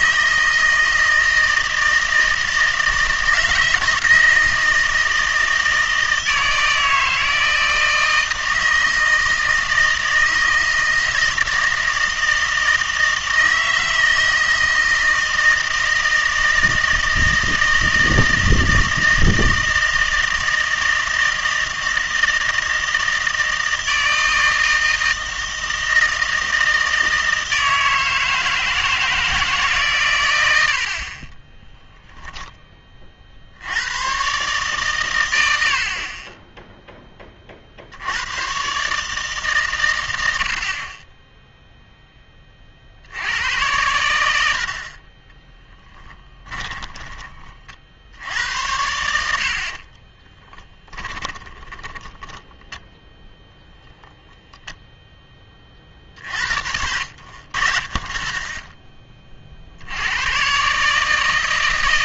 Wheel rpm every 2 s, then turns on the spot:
160, 160, 160, 160, 160, 160, 160, 160, 160, 160, 160, 160, 160, 160, 160, 80, 10, 130, 10, 120, 60, 30, 70, 20, 90, 10, 10, 0, 60, 20, 130.
46-48 50-52